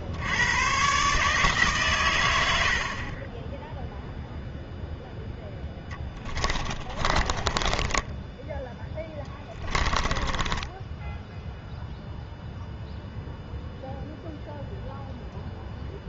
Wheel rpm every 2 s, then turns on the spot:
120, 60, 0, 20, 10, 10, 0, 0.
6-12